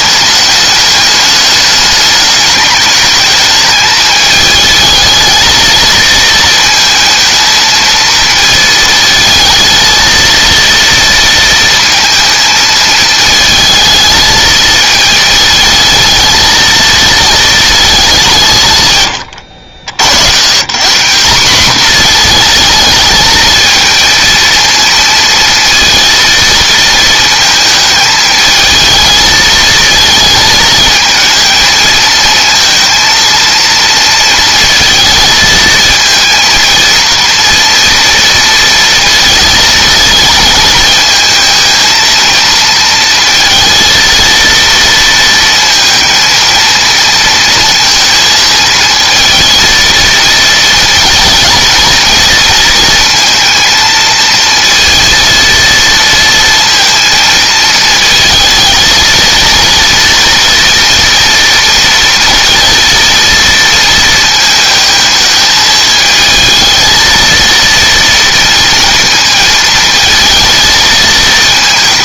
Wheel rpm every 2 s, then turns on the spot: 210, 200, 220, 220, 220, 230, 220, 220, 230, 150, 160, 220, 230, 230, 220, 220, 230, 220, 230, 230, 230, 230, 230, 230, 220, 230, 230, 230, 230, 230, 230, 230, 220, 220, 230, 230.
none